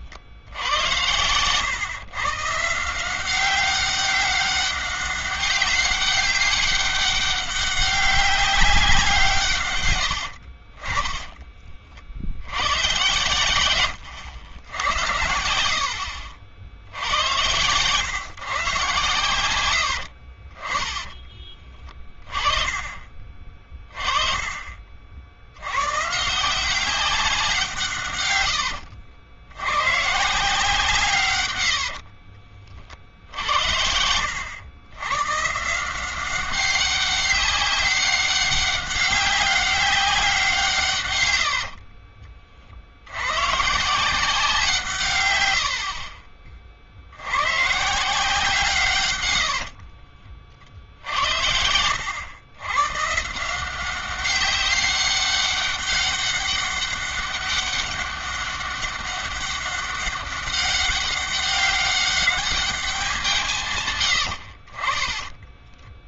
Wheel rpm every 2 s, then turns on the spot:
90, 170, 200, 200, 180, 30, 110, 80, 80, 130, 30, 30, 50, 180, 80, 150, 60, 100, 200, 200, 130, 70, 160, 60, 140, 60, 130, 200, 200, 200, 200, 190, 30.
10-12 20-22